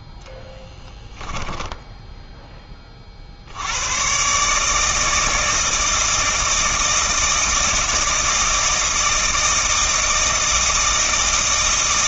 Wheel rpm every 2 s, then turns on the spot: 10, 20, 150, 160, 160, 160.
0-2